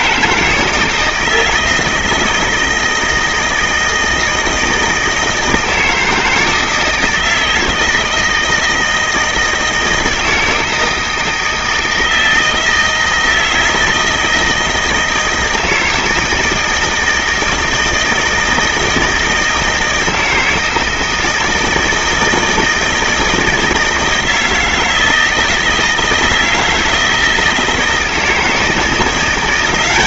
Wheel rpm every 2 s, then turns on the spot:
160, 160, 160, 160, 160, 160, 160, 160, 160, 160, 160, 160, 160, 160, 190.
none